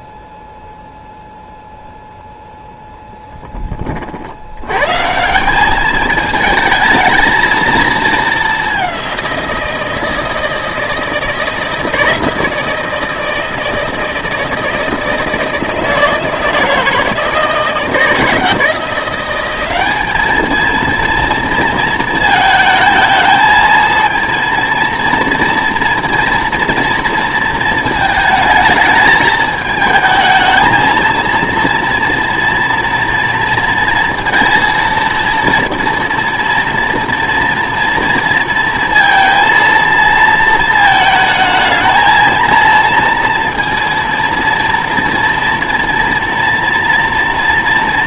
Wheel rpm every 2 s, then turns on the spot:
0, 0, 110, 220, 200, 160, 160, 160, 160, 170, 220, 220, 230, 230, 220, 220, 230, 230, 230, 230, 220, 230, 230, 240.
none